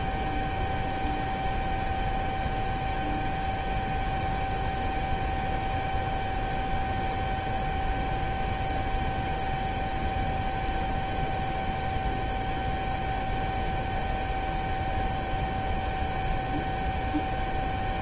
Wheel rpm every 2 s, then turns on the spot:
0, 0, 0, 0, 0, 0, 0, 0, 0.
none